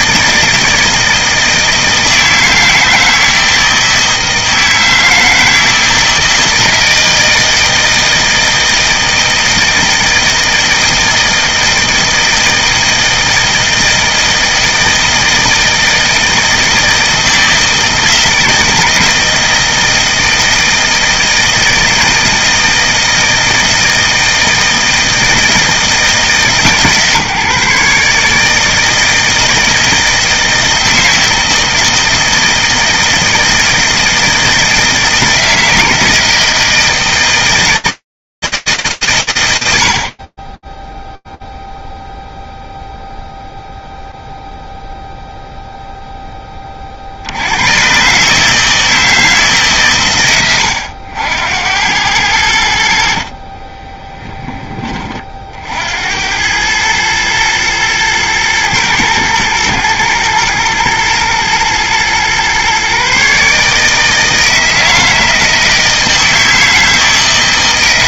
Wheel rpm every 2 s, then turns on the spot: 160, 160, 160, 160, 160, 160, 160, 160, 160, 160, 160, 160, 160, 150, 160, 160, 160, 160, 160, 110, 0, 0, 0, 50, 160, 90, 60, 30, 110, 110, 110, 140, 160, 160.
none